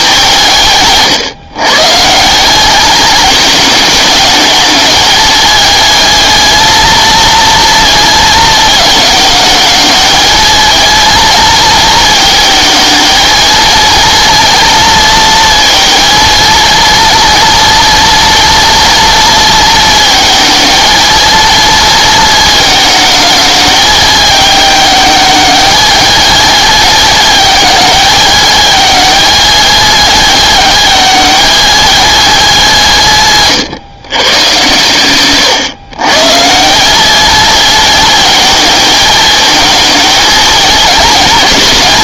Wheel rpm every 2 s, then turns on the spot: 160, 190, 210, 220, 220, 220, 220, 230, 230, 230, 220, 230, 210, 220, 210, 220, 200, 110, 170, 220, 220.
none